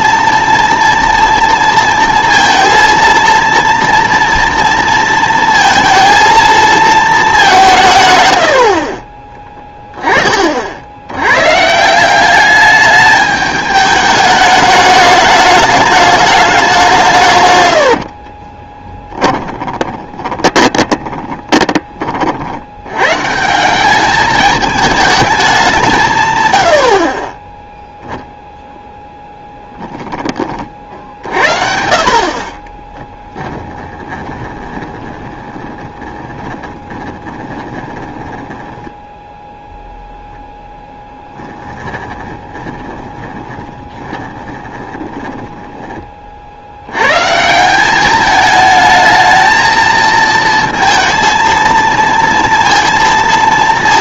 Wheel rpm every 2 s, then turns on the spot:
230, 230, 230, 220, 70, 50, 210, 210, 190, 20, 20, 80, 210, 90, 0, 40, 30, 20, 20, 10, 10, 20, 20, 70, 220, 230, 230.
18-22 32-40 42-46